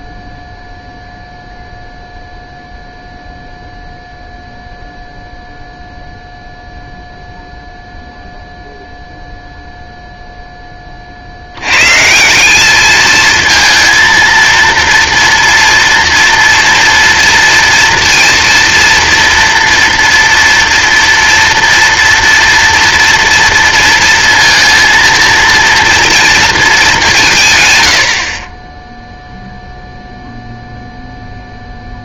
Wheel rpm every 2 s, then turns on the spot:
0, 0, 0, 0, 0, 10, 190, 230, 240, 230, 240, 230, 230, 230, 40, 0.
none